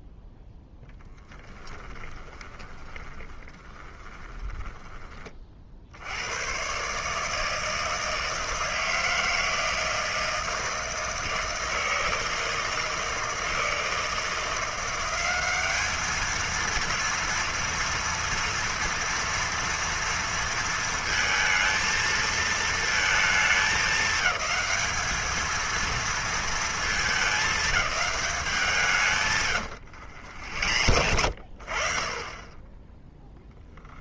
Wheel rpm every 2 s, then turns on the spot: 0, 20, 20, 120, 160, 160, 160, 170, 220, 240, 230, 220, 210, 220, 190, 90, 20.
2-6 30-32